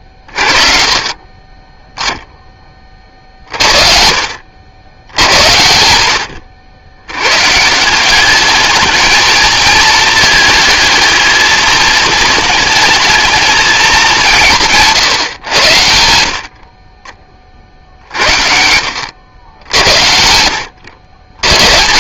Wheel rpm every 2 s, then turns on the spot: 40, 40, 90, 100, 220, 220, 220, 150, 30, 90, 100.
none